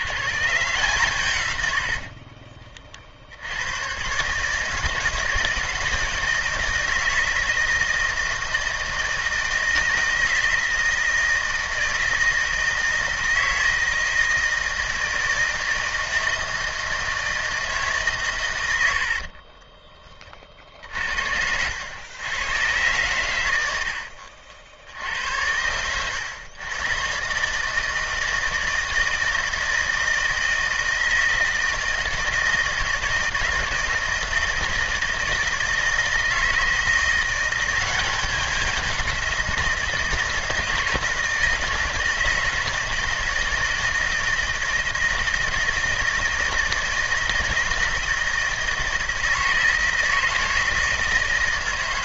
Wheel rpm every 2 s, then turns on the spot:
130, 40, 150, 160, 160, 170, 160, 160, 160, 100, 50, 110, 60, 110, 160, 160, 160, 160, 160, 190, 160, 160, 160, 160, 160, 160.
20-22